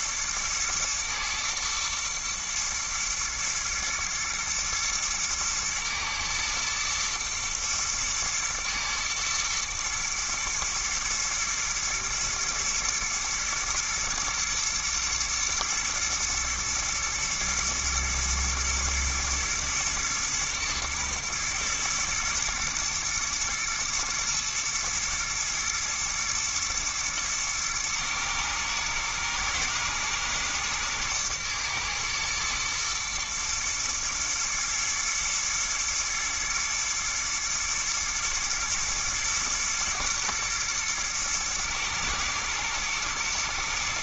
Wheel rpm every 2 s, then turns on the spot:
120, 120, 110, 110, 110, 110, 110, 110, 110, 110, 110, 120, 110, 120, 110, 120, 120, 120, 120, 120, 110, 110.
none